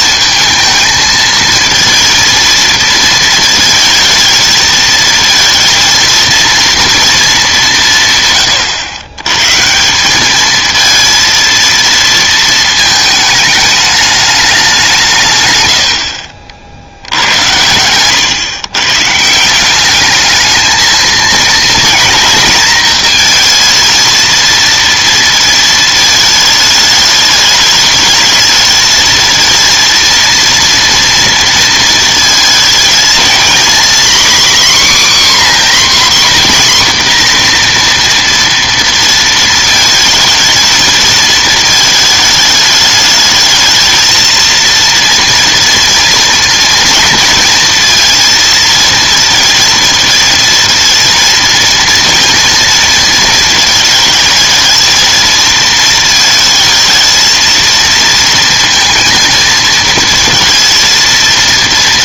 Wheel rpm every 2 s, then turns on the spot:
220, 230, 220, 230, 120, 220, 220, 190, 60, 120, 220, 230, 230, 220, 220, 230, 230, 270, 260, 230, 230, 210, 230, 230, 230, 230, 230, 220, 220, 230, 230.
none